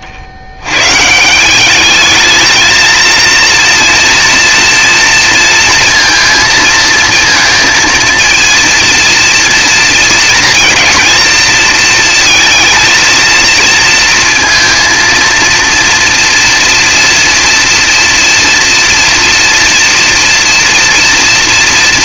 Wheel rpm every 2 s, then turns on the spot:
120, 220, 230, 220, 230, 220, 230, 230, 230, 230, 240.
none